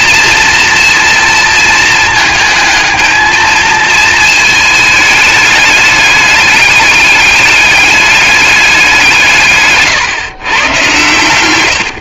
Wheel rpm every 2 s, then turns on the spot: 240, 220, 220, 210, 200, 120.
none